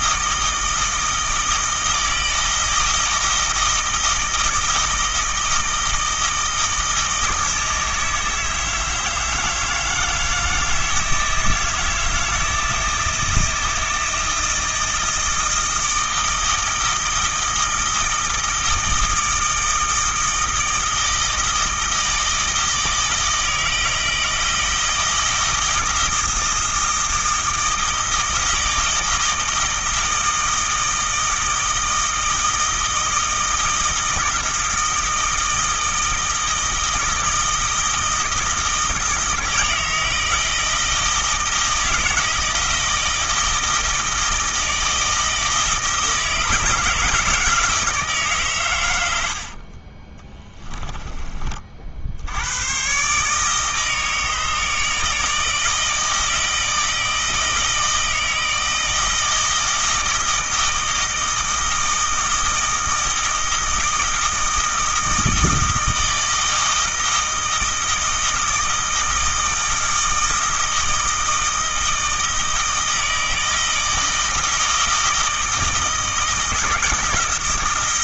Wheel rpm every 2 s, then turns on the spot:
160, 160, 160, 160, 160, 160, 160, 160, 160, 160, 160, 160, 160, 160, 160, 160, 160, 170, 160, 160, 160, 160, 160, 160, 120, 10, 100, 160, 160, 160, 160, 160, 160, 160, 160, 160, 160, 160, 160.
50-52